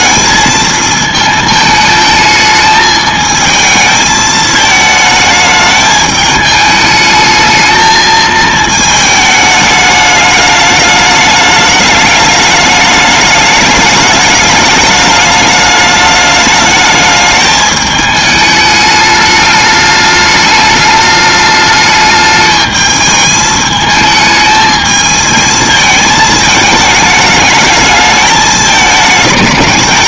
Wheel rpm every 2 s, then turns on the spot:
220, 220, 220, 210, 220, 210, 210, 210, 210, 210, 210, 210, 220, 210, 210.
none